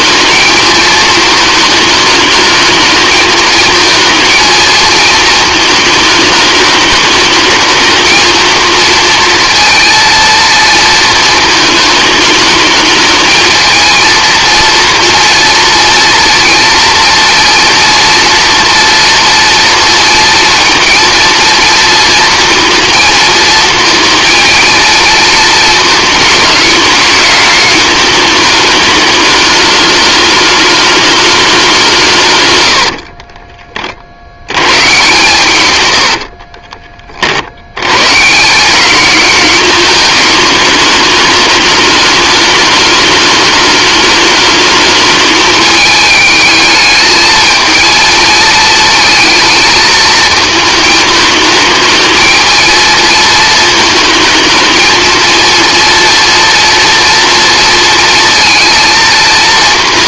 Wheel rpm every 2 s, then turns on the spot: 220, 220, 220, 210, 230, 220, 210, 230, 230, 230, 230, 230, 230, 210, 210, 210, 70, 120, 30, 200, 210, 210, 220, 220, 220, 220, 220, 230, 230, 230.
32-34